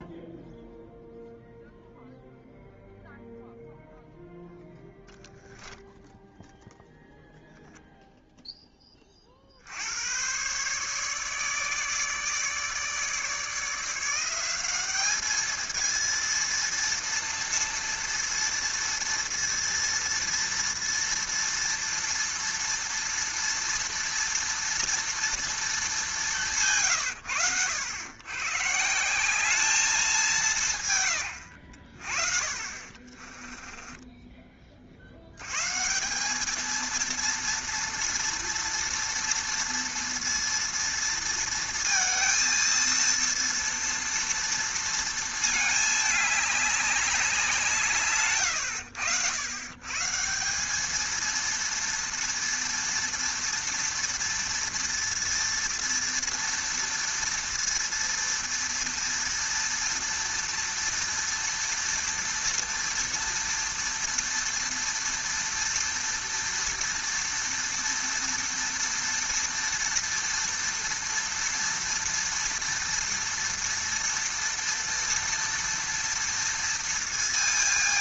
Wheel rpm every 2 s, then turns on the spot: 0, 0, 0, 0, 10, 130, 150, 190, 230, 230, 230, 230, 230, 140, 140, 160, 40, 30, 220, 230, 230, 230, 230, 200, 110, 200, 230, 230, 230, 230, 230, 230, 230, 230, 230, 230, 230, 230, 230.
32-34